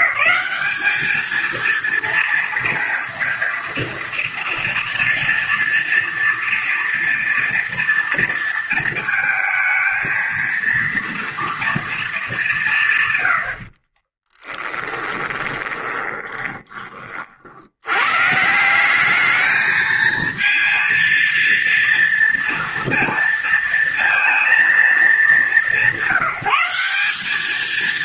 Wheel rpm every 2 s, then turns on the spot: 200, 230, 230, 230, 230, 230, 190, 20, 30, 180, 220, 230, 230, 190.
14-18